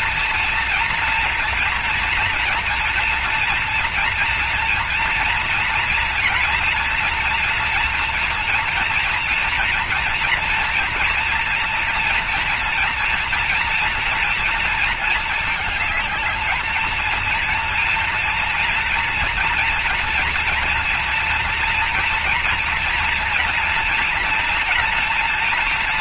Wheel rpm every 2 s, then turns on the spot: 230, 240, 230, 230, 230, 230, 240, 230, 220, 230, 230, 240, 230.
none